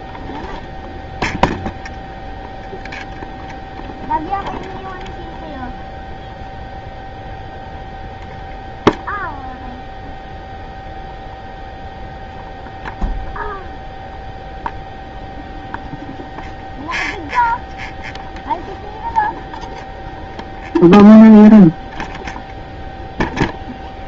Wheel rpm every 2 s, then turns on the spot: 0, 0, 0, 0, 0, 0, 0, 0, 0, 0, 0, 0.
none